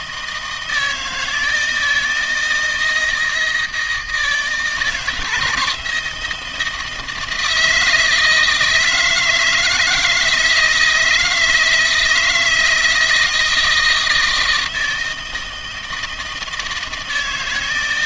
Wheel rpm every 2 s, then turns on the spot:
160, 170, 160, 160, 160, 160, 160, 160, 160.
none